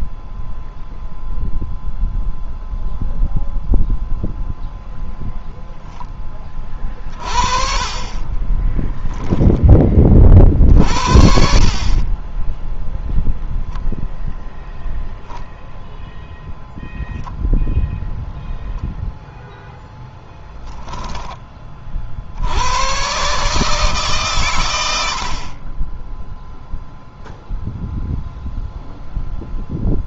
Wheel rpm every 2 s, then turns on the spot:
0, 0, 0, 30, 10, 50, 0, 0, 0, 0, 0, 110, 80, 0, 0.
8-10